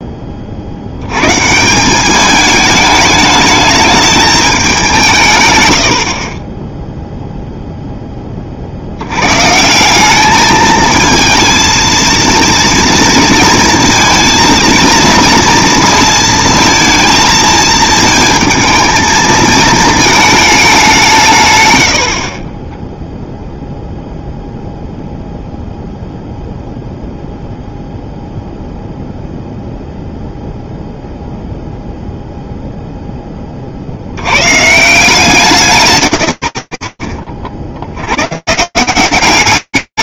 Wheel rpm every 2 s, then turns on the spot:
30, 210, 220, 30, 30, 210, 230, 230, 230, 220, 220, 50, 0, 0, 0, 0, 0, 80, 90, 150.
none